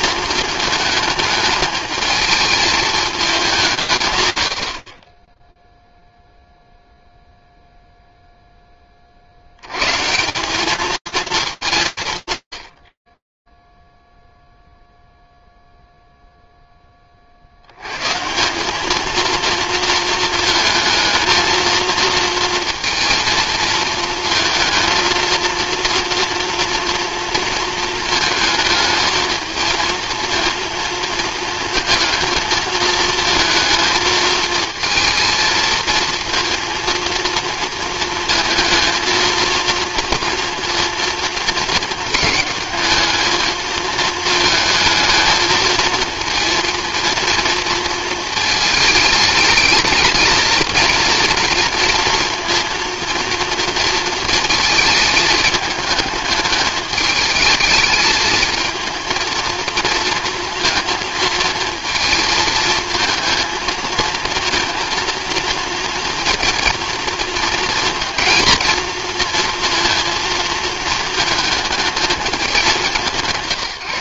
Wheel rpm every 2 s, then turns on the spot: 220, 220, 100, 0, 0, 200, 120, 0, 0, 180, 220, 230, 220, 230, 220, 230, 220, 220, 230, 230, 230, 220, 220, 230, 220, 230, 230, 220, 210, 220, 230, 230, 230, 230, 230, 220, 190.
none